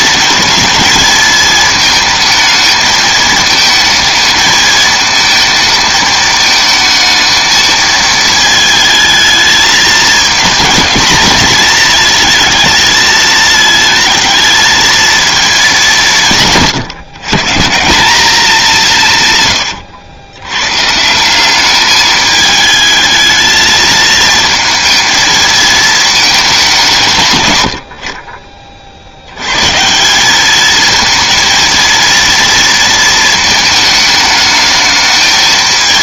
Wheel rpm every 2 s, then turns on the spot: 220, 220, 220, 220, 220, 220, 220, 220, 140, 150, 170, 220, 230, 130, 110, 230, 220, 220.
18-20